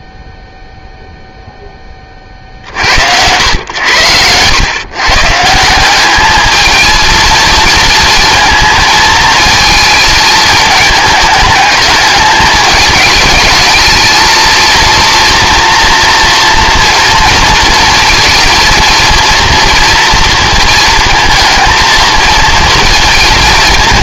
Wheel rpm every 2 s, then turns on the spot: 0, 70, 140, 220, 220, 210, 210, 230, 230, 230, 220, 220.
none